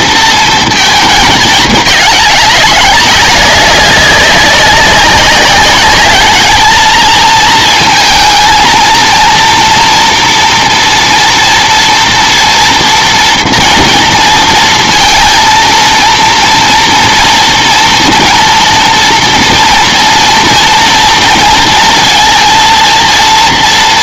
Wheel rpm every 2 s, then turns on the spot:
230, 200, 190, 220, 230, 230, 230, 230, 230, 230, 230, 230.
none